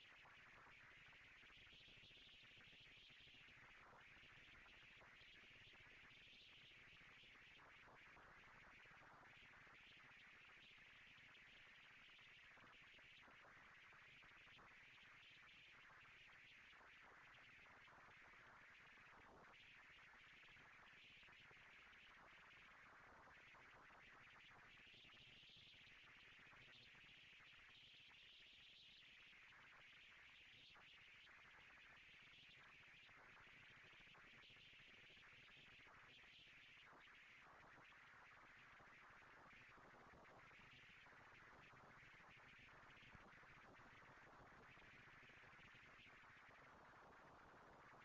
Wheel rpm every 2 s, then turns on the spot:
210, 220, 230, 200, 130, 110, 150, 210, 230, 230, 230, 230, 230, 240, 230, 220, 230, 230, 230, 230, 230, 200, 200, 200.
none